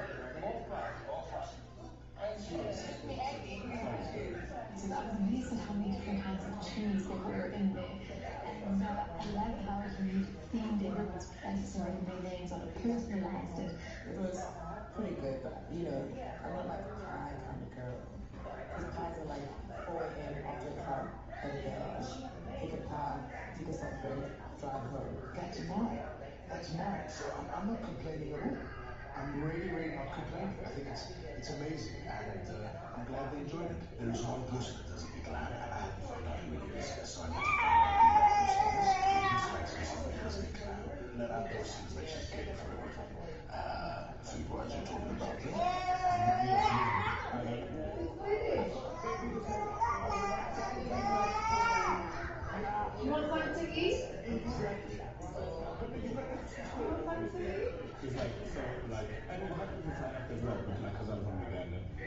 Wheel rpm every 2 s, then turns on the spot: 0, 0, 0, 0, 0, 0, 0, 0, 0, 0, 0, 0, 0, 0, 0, 0, 0, 0, 0, 0, 0, 0, 0, 0, 0, 0, 0, 0, 0, 0, 0.
none